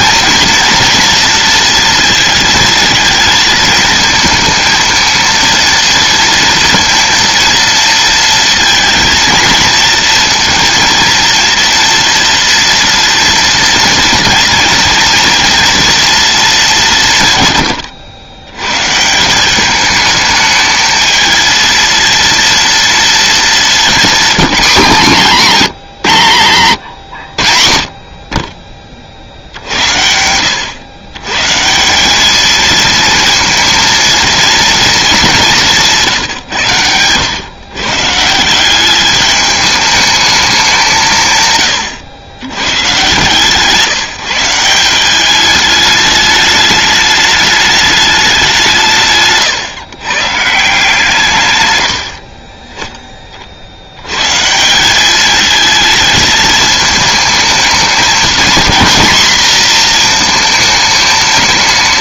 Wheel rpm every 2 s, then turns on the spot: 240, 230, 230, 230, 230, 230, 230, 230, 200, 120, 220, 230, 220, 130, 40, 100, 220, 230, 120, 180, 190, 120, 170, 210, 180, 150, 30, 150, 220, 240, 220.
none